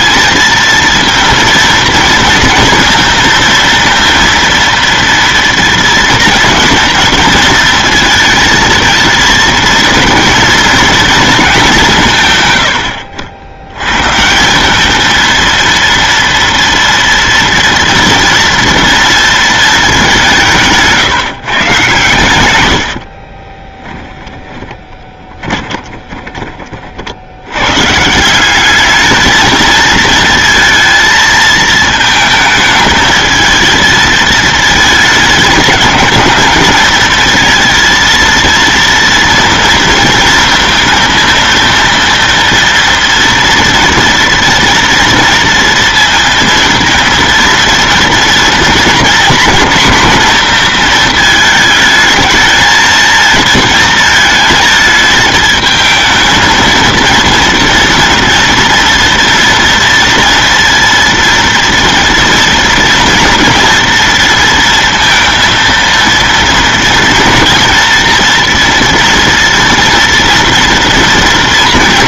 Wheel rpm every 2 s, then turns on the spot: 230, 230, 230, 220, 220, 230, 100, 190, 230, 230, 160, 100, 10, 40, 200, 230, 220, 220, 220, 230, 230, 230, 230, 230, 230, 230, 220, 220, 230, 230, 230, 230, 230, 230, 230, 230.
12-14 24-26